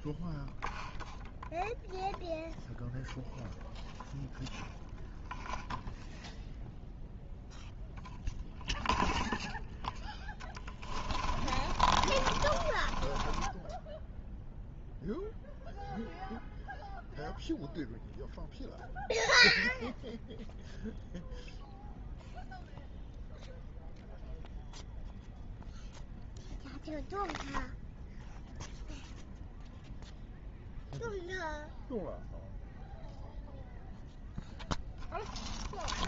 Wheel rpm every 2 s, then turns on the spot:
0, 0, 0, 0, 0, 10, 30, 0, 0, 0, 0, 0, 0, 0, 0, 0, 0, 0.
10-14